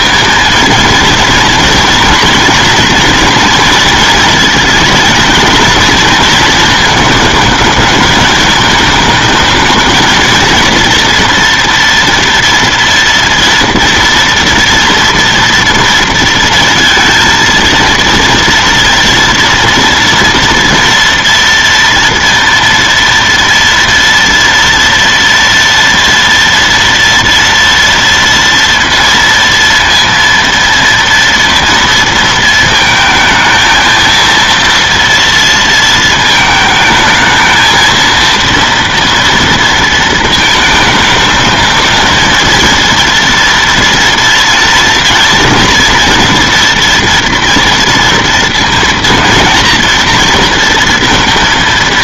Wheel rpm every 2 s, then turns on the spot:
230, 230, 220, 220, 210, 230, 230, 230, 230, 230, 230, 230, 230, 230, 230, 230, 230, 230, 220, 230, 220, 230, 230, 230, 230, 230.
none